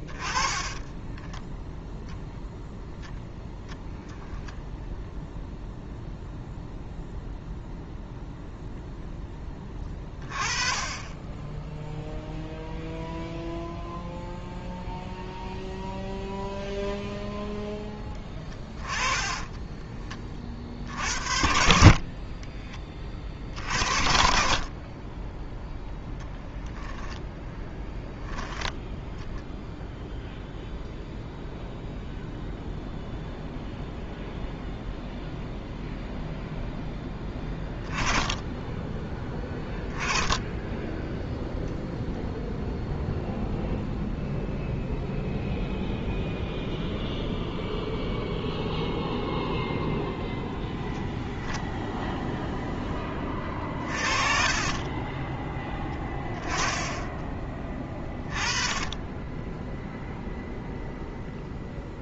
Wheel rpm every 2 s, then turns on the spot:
20, 10, 10, 0, 0, 20, 0, 0, 0, 20, 40, 20, 40, 0, 0, 0, 0, 0, 0, 10, 10, 0, 0, 0, 0, 0, 0, 20, 10, 20, 0.
0-2 18-20 22-24 40-42